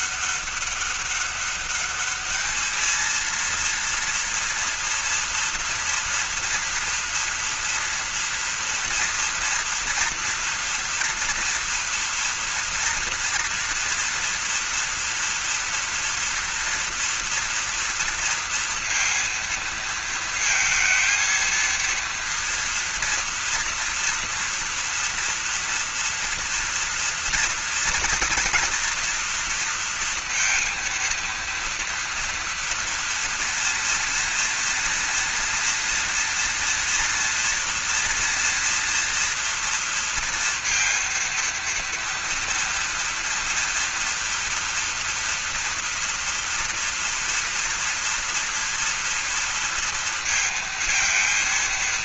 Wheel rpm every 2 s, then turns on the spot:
200, 220, 230, 230, 240, 240, 230, 230, 230, 230, 230, 230, 230, 230, 230, 230, 230, 230, 230, 230, 230, 230, 240, 230, 240, 230.
none